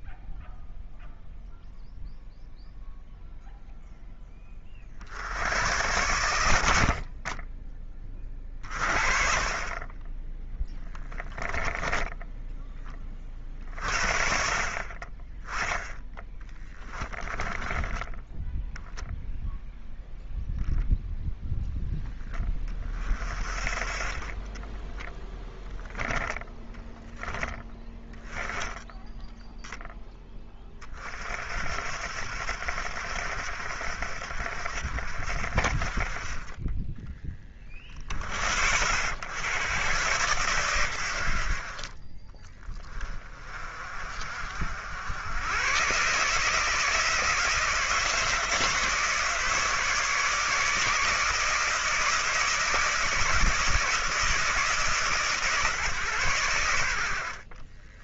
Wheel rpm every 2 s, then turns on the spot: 0, 0, 60, 60, 30, 10, 20, 40, 10, 0, 0, 30, 10, 10, 10, 30, 70, 60, 20, 100, 100, 20, 60, 160, 160, 150, 160, 140, 80.
16-18 24-26